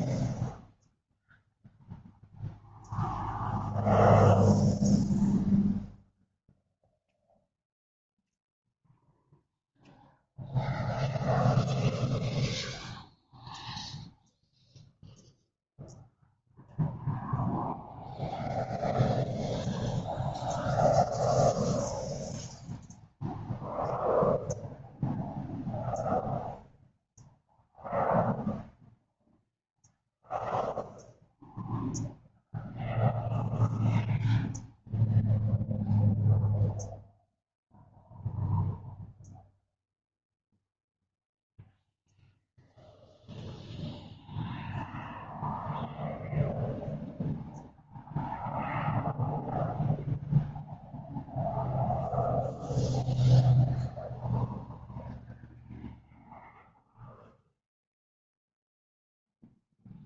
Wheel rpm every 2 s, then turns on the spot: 0, 0, 0, 0, 0, 0, 0, 0, 0, 0, 0, 0, 0, 0, 0, 0, 0, 0, 0, 0, 0, 0, 0, 0, 0, 0, 0, 0, 0, 0.
none